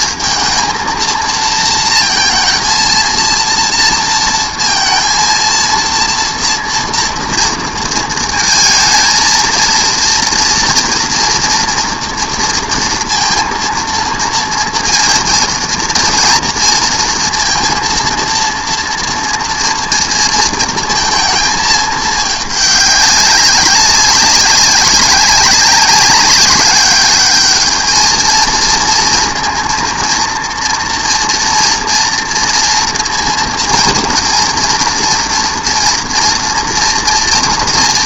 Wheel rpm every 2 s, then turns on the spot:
220, 230, 230, 230, 230, 230, 230, 230, 230, 230, 230, 210, 190, 200, 220, 230, 230, 230, 230.
none